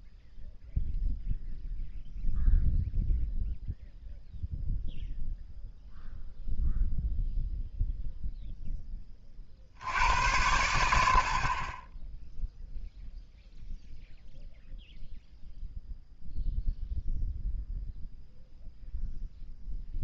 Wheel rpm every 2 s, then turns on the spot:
0, 0, 0, 0, 10, 90, 0, 0, 0, 0.
none